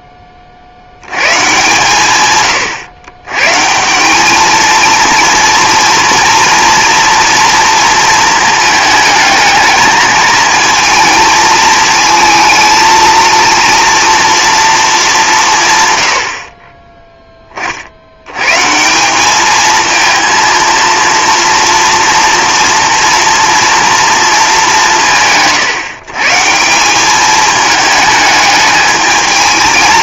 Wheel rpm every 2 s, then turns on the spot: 60, 120, 220, 230, 220, 220, 230, 220, 20, 150, 230, 230, 190, 180, 210.
none